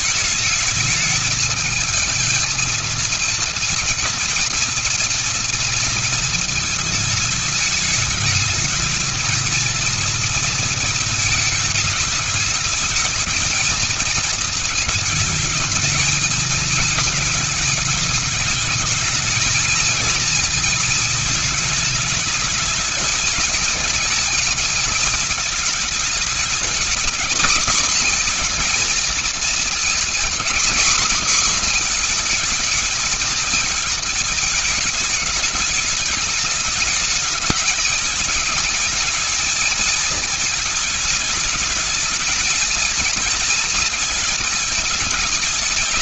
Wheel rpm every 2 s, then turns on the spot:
220, 230, 230, 220, 220, 230, 220, 220, 220, 210, 220, 210, 230, 220, 240, 230, 230, 220, 220, 220, 220, 230, 210.
none